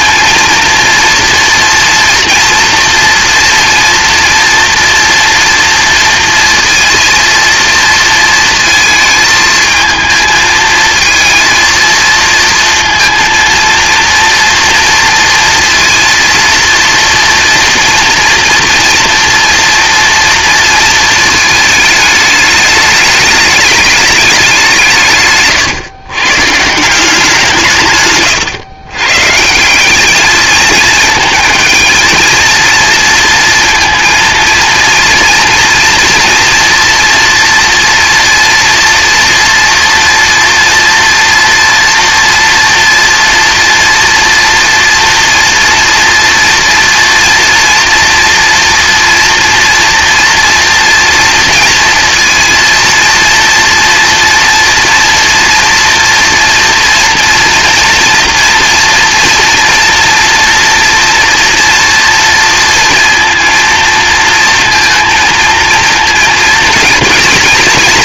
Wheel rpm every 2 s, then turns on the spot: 230, 230, 240, 230, 220, 220, 230, 230, 230, 230, 230, 210, 170, 160, 120, 220, 230, 230, 230, 230, 230, 230, 230, 230, 230, 240, 230, 230, 230, 230, 230, 230, 230, 230.
none